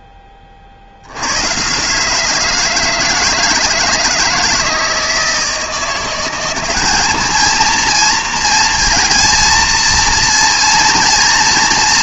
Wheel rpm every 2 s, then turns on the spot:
70, 160, 160, 200, 230, 230.
none